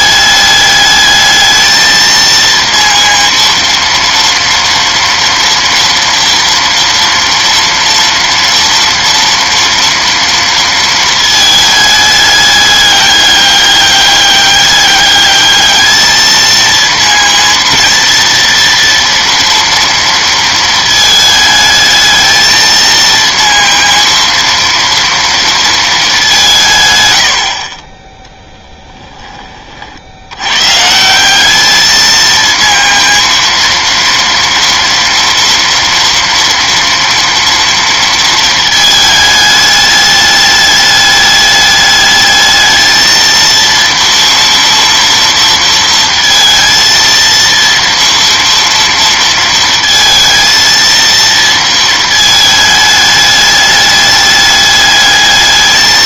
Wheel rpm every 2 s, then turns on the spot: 210, 230, 230, 230, 230, 230, 200, 200, 220, 230, 230, 220, 230, 170, 10, 110, 230, 230, 230, 220, 210, 220, 230, 230, 230, 230, 220, 210.
none